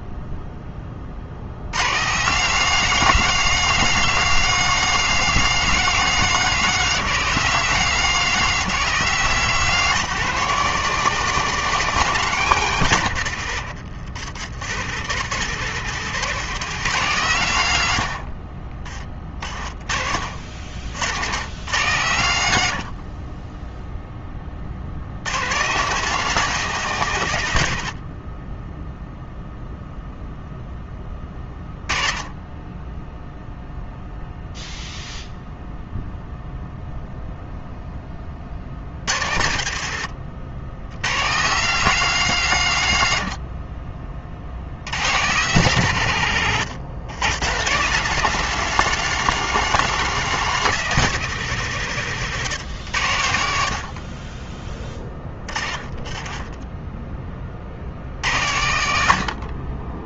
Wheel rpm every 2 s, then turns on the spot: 30, 200, 210, 210, 200, 210, 140, 110, 160, 40, 70, 70, 70, 170, 10, 10, 10, 0, 0, 80, 120, 120, 90, 130, 210, 190, 120, 20, 20, 70.
none